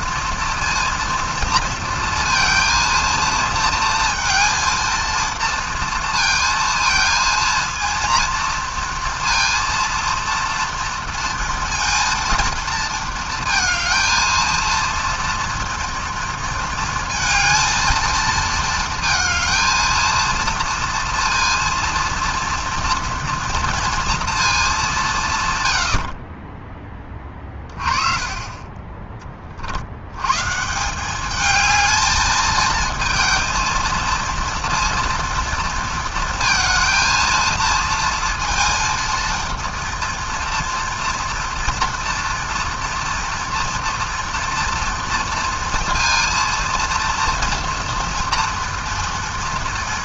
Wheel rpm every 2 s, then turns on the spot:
230, 230, 230, 230, 230, 230, 230, 230, 230, 220, 230, 230, 200, 20, 20, 170, 220, 230, 230, 230, 230, 230, 230, 230, 230.
none